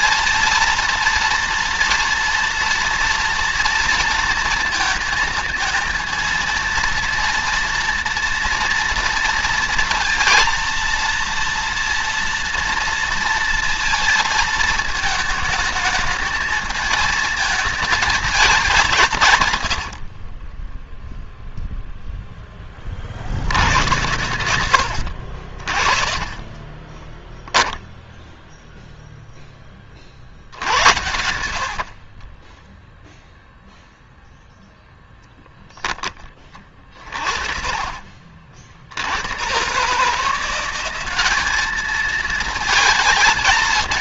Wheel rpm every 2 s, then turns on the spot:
230, 240, 230, 230, 230, 230, 230, 230, 220, 200, 30, 10, 90, 30, 0, 70, 30, 0, 30, 60, 170, 220.
20-22 26-28 30-34